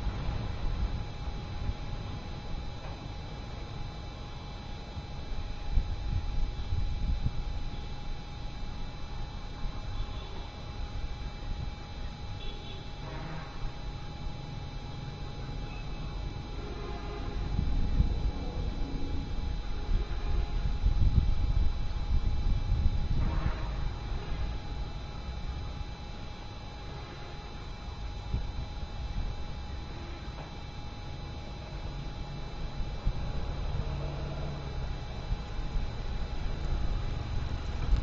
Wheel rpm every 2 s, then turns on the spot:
0, 0, 0, 0, 0, 0, 0, 0, 0, 0, 0, 0, 0, 0, 0, 0, 0, 0, 0.
none